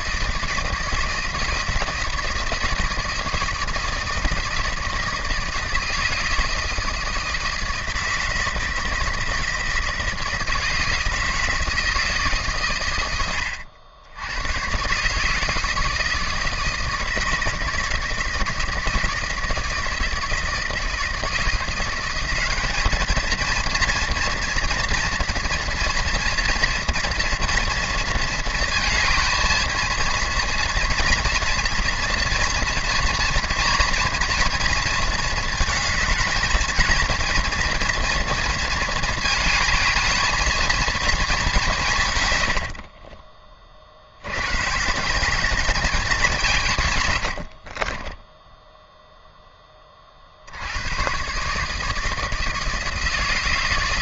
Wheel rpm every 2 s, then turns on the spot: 160, 160, 160, 160, 160, 160, 130, 120, 160, 160, 160, 200, 230, 230, 230, 230, 230, 230, 220, 230, 230, 60, 140, 140, 0, 90, 160.
42-44